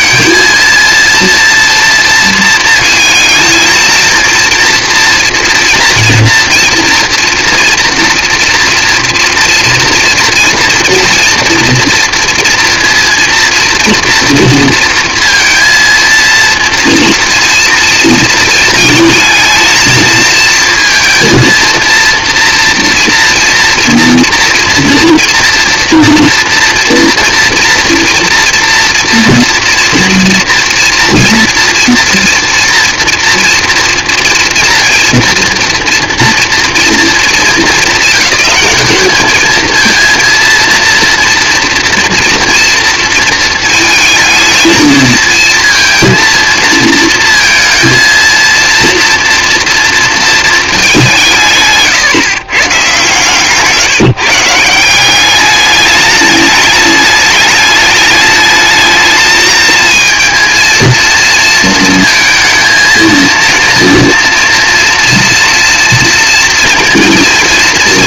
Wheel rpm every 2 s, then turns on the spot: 230, 220, 230, 230, 230, 230, 230, 230, 230, 220, 230, 230, 230, 240, 240, 230, 230, 230, 230, 200, 230, 230, 220, 230, 230, 220, 140, 160, 210, 210, 230, 230, 230, 230.
none